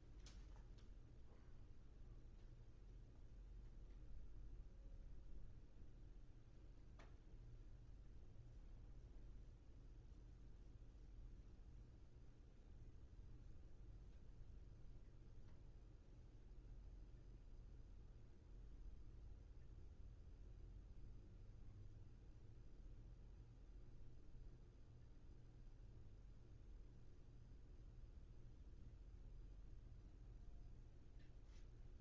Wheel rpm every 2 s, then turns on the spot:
0, 0, 0, 0, 0, 0, 0, 0, 0, 0, 0, 0, 0, 0, 0, 0.
none